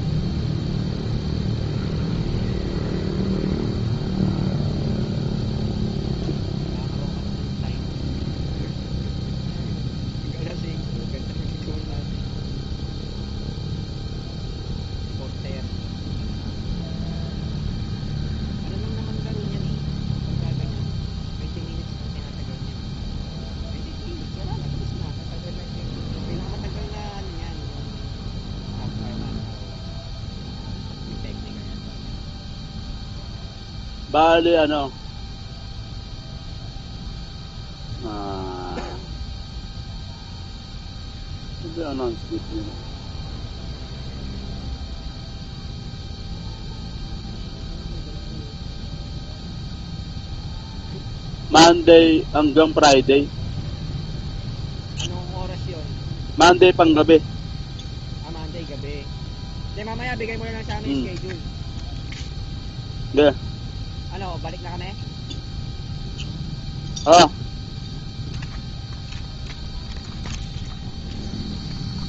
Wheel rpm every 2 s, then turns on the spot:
0, 0, 0, 0, 0, 0, 0, 0, 0, 0, 0, 0, 0, 0, 0, 0, 0, 0, 0, 0, 0, 0, 0, 0, 0, 0, 0, 0, 0, 0, 0, 0, 0, 0, 0, 0.
none